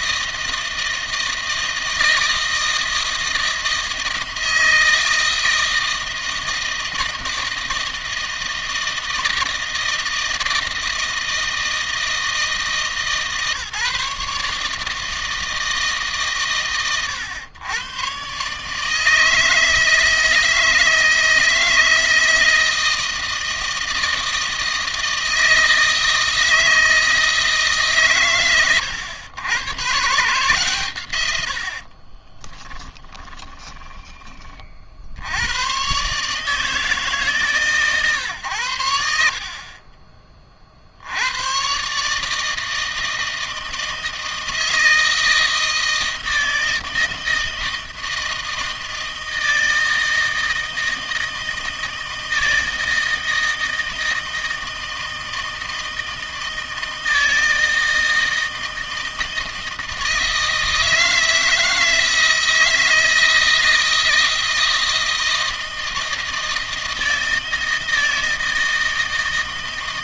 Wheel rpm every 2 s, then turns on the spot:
160, 160, 160, 160, 160, 160, 160, 150, 110, 140, 160, 160, 160, 160, 120, 140, 20, 40, 150, 90, 40, 160, 160, 160, 160, 160, 160, 160, 160, 160, 160, 160, 160, 160, 160.
32-34